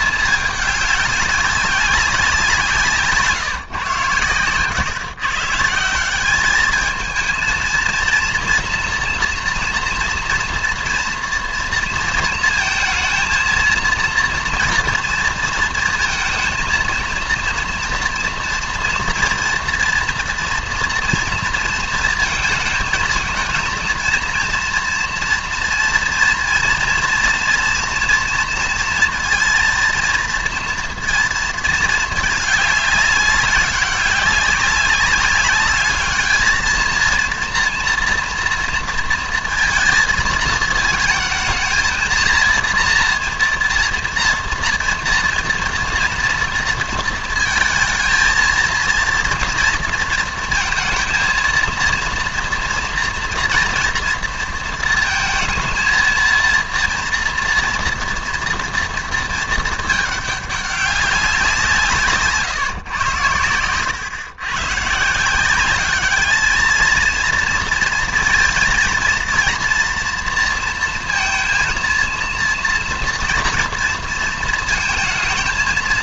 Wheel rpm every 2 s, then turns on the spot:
210, 170, 120, 210, 230, 230, 220, 230, 220, 230, 240, 230, 230, 240, 230, 230, 210, 200, 220, 230, 220, 230, 230, 230, 230, 230, 230, 230, 230, 230, 200, 140, 120, 220, 230, 230, 230, 230.
none